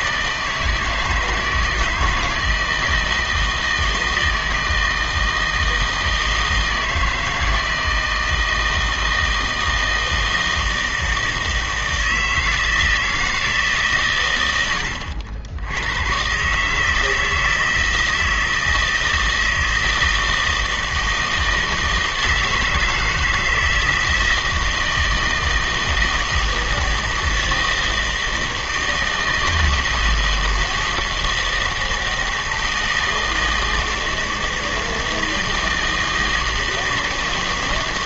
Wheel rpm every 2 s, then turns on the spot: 160, 160, 160, 160, 160, 160, 160, 90, 140, 160, 160, 160, 160, 160, 160, 160, 160, 160, 160.
none